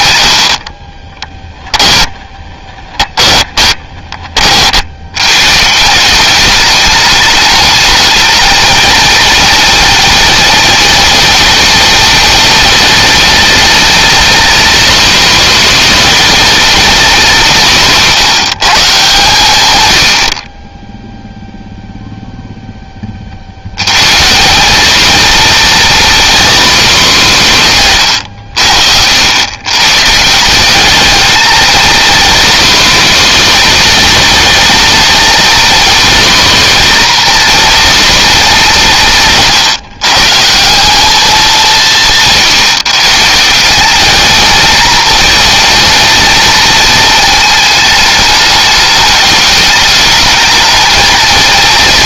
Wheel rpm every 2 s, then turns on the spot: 20, 20, 80, 210, 220, 220, 220, 230, 220, 140, 10, 20, 220, 210, 70, 200, 230, 230, 240, 180, 210, 150, 220, 220, 210, 220.
0-4